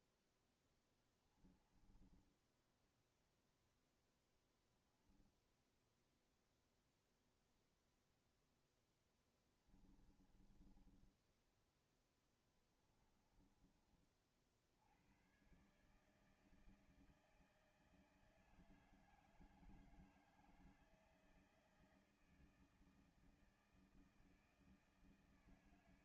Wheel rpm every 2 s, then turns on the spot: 10, 10, 0, 0, 0, 10, 20, 50, 160, 160, 160, 160, 160.
10-14